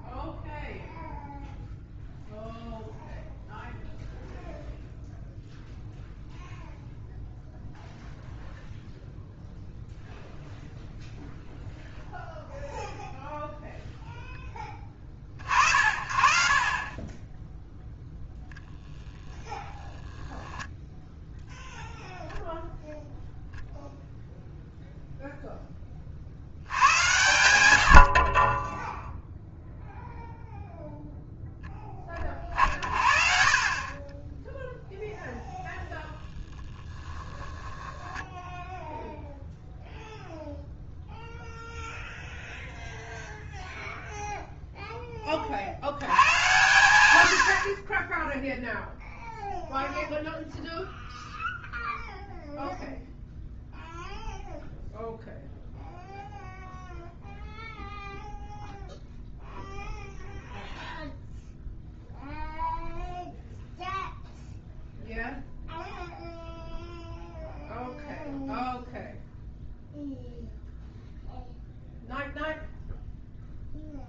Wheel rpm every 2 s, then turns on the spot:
0, 0, 0, 0, 0, 0, 0, 20, 40, 0, 0, 0, 0, 80, 10, 0, 60, 0, 10, 0, 0, 0, 0, 120, 0, 0, 0, 0, 0, 0, 0, 0, 0, 0, 0, 0, 0.
36-38